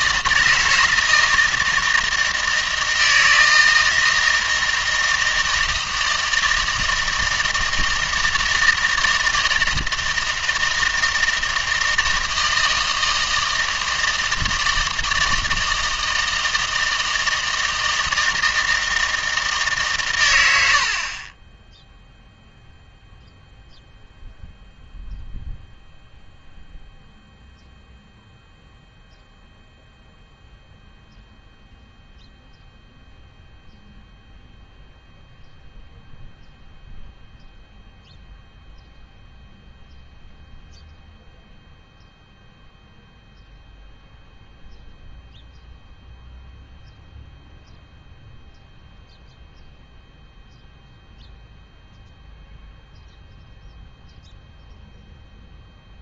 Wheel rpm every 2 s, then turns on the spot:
160, 160, 160, 160, 160, 160, 160, 160, 160, 160, 80, 0, 0, 0, 0, 0, 0, 0, 0, 0, 0, 0, 0, 0, 0, 0, 0, 0.
none